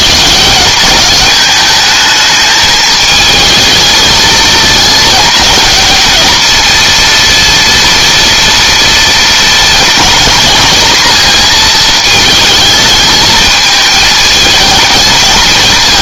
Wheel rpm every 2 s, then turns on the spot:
190, 220, 210, 230, 230, 230, 220, 220.
none